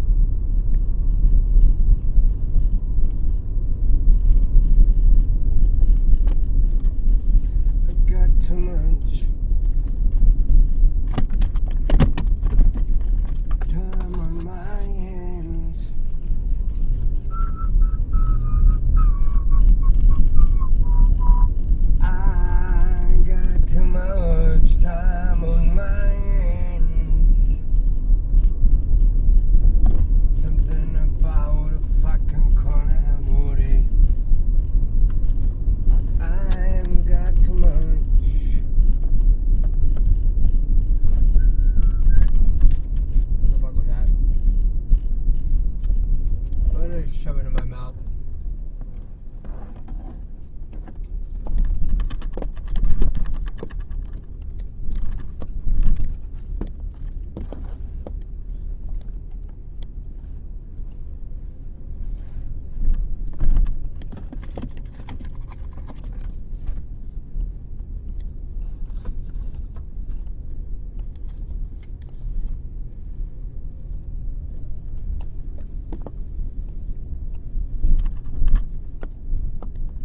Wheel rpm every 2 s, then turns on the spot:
0, 0, 0, 0, 0, 0, 0, 0, 0, 0, 0, 0, 0, 0, 0, 0, 0, 0, 0, 0, 0, 0, 0, 0, 0, 0, 0, 0, 0, 0, 0, 0, 0, 0, 0, 0, 0, 0, 0, 0.
none